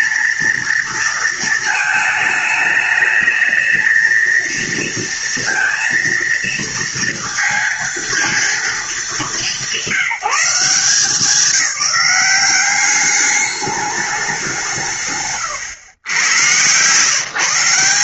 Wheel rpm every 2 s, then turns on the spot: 230, 220, 230, 230, 220, 190, 200, 170, 120.
none